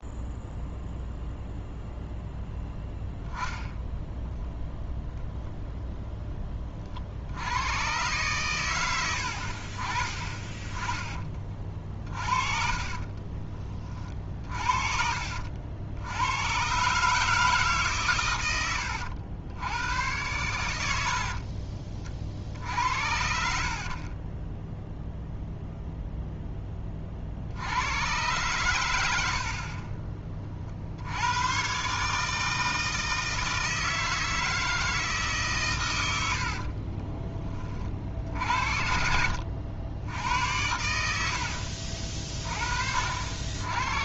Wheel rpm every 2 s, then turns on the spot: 0, 10, 0, 30, 110, 20, 40, 40, 120, 100, 100, 60, 10, 10, 100, 50, 160, 160, 60, 60, 90, 40.
12-14 18-22 24-26 36-38